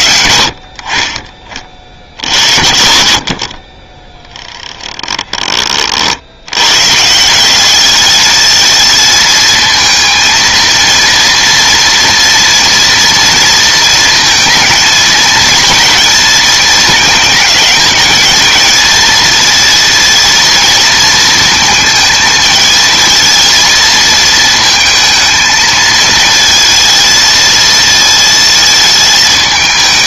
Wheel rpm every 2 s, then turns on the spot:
70, 60, 20, 120, 220, 230, 230, 220, 220, 220, 230, 220, 220, 230, 220.
4-6